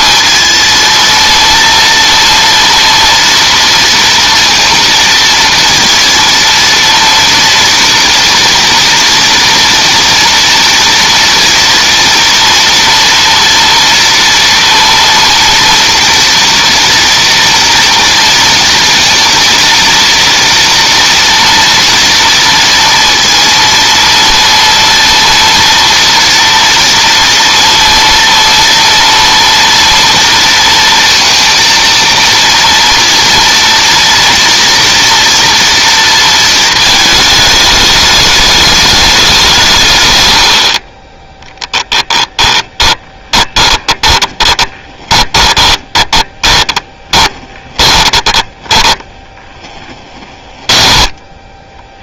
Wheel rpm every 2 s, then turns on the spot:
230, 230, 230, 230, 230, 230, 230, 230, 230, 230, 230, 230, 230, 240, 230, 230, 230, 230, 220, 210, 40, 20, 20, 20, 10, 10.
42-52